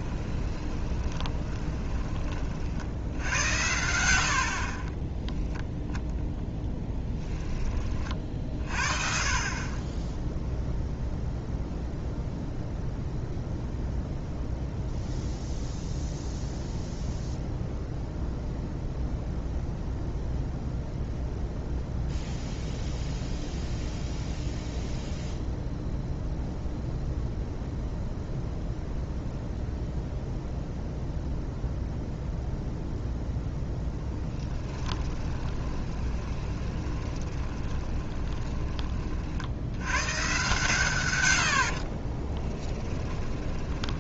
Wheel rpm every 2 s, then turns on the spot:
30, 60, 30, 10, 40, 0, 0, 0, 0, 0, 0, 0, 0, 0, 0, 0, 0, 10, 20, 20, 130, 20.
0-2 6-8 34-38 42-44